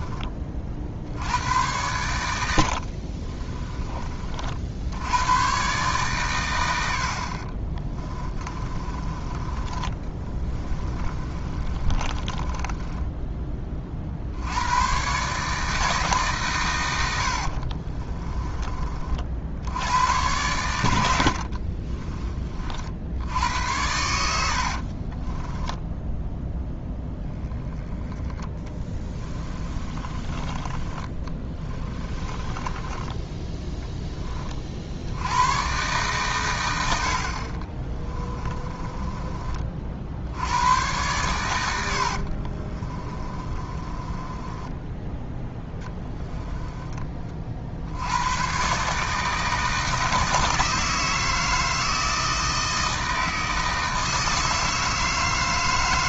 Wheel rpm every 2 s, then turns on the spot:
70, 70, 80, 100, 20, 20, 20, 100, 100, 30, 100, 50, 60, 10, 20, 20, 20, 50, 90, 20, 100, 30, 10, 20, 130, 160, 160, 160.
2-4 8-14 24-26 28-34 38-40 42-48